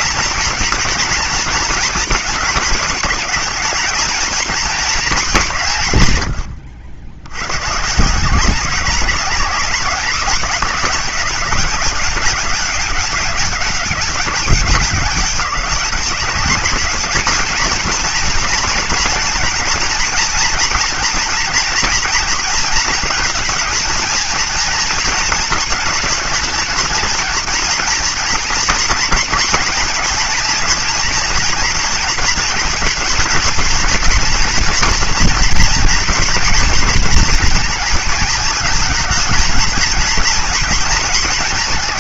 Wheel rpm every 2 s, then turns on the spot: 230, 230, 220, 100, 190, 200, 200, 200, 200, 230, 230, 230, 230, 220, 230, 240, 230, 240, 230, 220, 230.
none